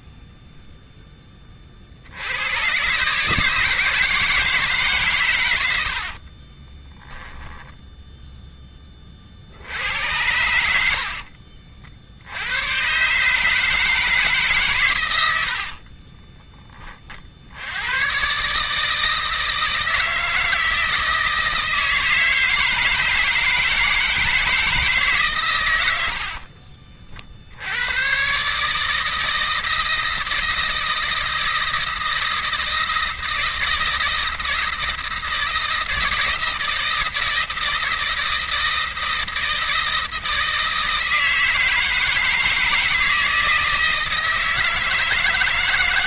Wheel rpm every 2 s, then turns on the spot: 20, 140, 140, 20, 40, 60, 140, 90, 50, 160, 160, 160, 140, 50, 160, 160, 160, 160, 160, 160, 160, 160, 160.
6-8 10-12 14-16